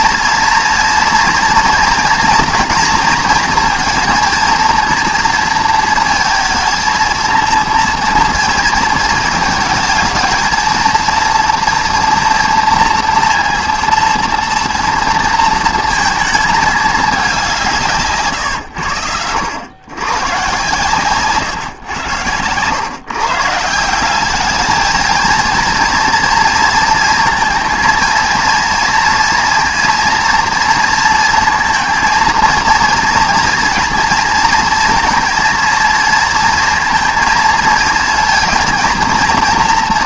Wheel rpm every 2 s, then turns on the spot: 230, 240, 230, 230, 230, 230, 230, 230, 220, 110, 140, 130, 220, 230, 230, 230, 230, 230, 230, 230.
none